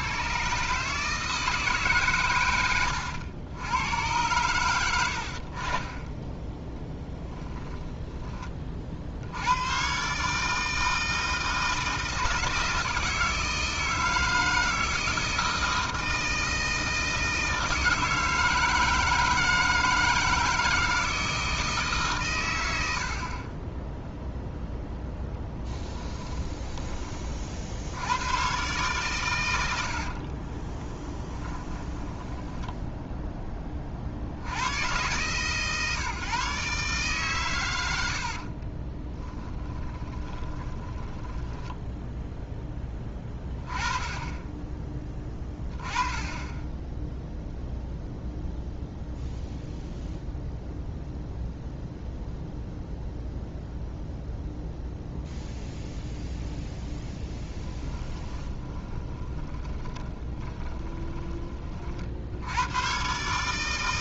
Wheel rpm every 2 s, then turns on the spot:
140, 100, 100, 20, 40, 160, 160, 160, 160, 160, 160, 90, 0, 20, 130, 20, 10, 90, 150, 30, 20, 10, 20, 10, 0, 0, 0, 0, 10, 20, 20, 110.
2-4 6-8 30-34 38-42 58-62